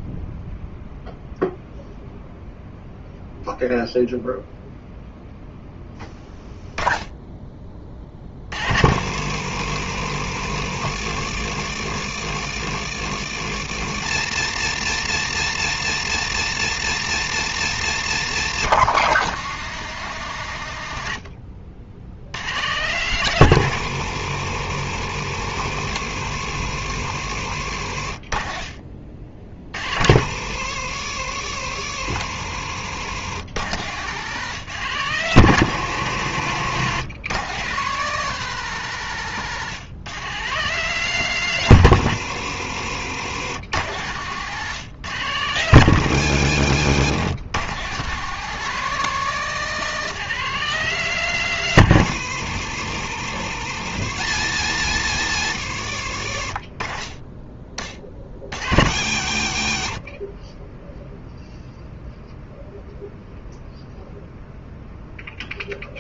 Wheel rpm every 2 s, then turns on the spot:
0, 0, 0, 10, 60, 70, 80, 120, 120, 150, 60, 120, 70, 70, 50, 70, 100, 110, 110, 130, 140, 80, 110, 110, 160, 150, 70, 100, 20, 70, 0, 0, 0.
20-22 26-28